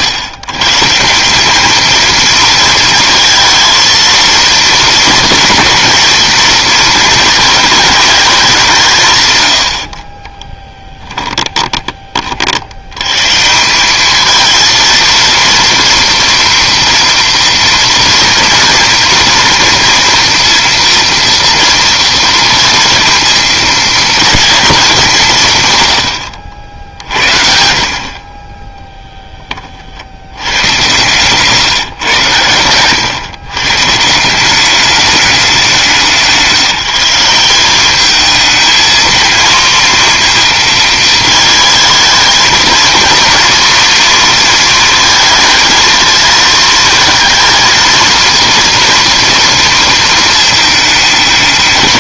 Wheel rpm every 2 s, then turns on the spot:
120, 230, 230, 230, 170, 10, 80, 230, 240, 230, 230, 230, 210, 70, 10, 100, 110, 200, 180, 220, 220, 220, 230, 220, 230, 220.
10-12 30-32